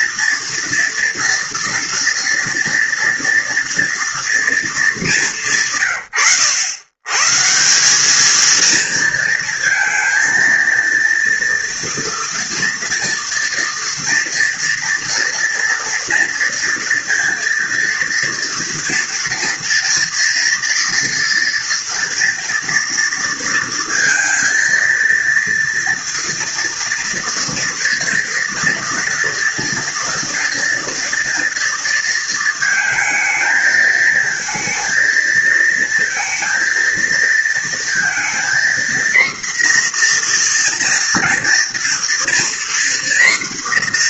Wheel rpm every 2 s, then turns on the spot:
230, 230, 220, 110, 230, 230, 230, 230, 230, 230, 230, 230, 230, 230, 230, 230, 220, 220, 230, 240, 240, 240.
none